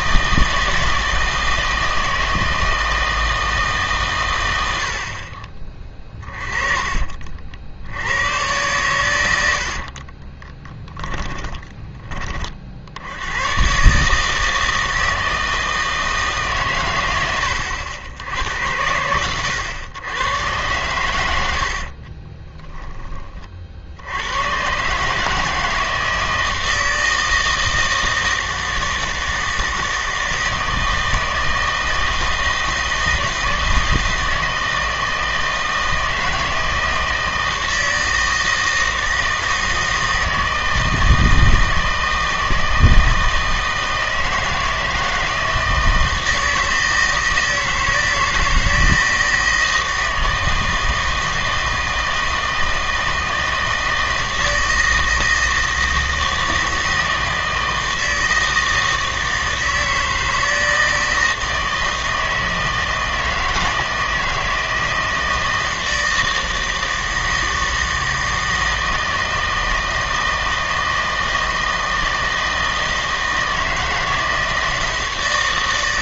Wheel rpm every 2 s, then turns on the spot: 160, 160, 90, 30, 110, 20, 50, 160, 140, 90, 120, 10, 130, 160, 160, 160, 160, 160, 160, 160, 160, 160, 160, 160, 160, 160, 160, 160, 160, 160, 160, 160, 160, 160, 160, 160, 160, 160.
6-8 10-12 22-24